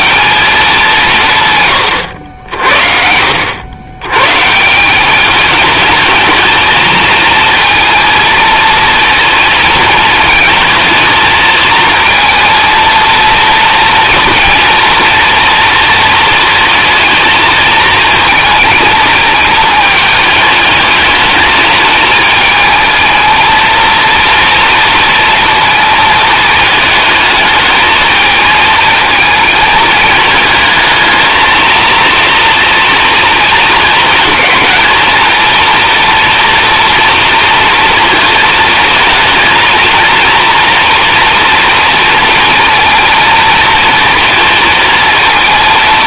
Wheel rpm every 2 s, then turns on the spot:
190, 70, 170, 220, 230, 220, 230, 230, 230, 220, 210, 220, 230, 220, 220, 220, 230, 220, 230, 220, 240, 230, 230.
none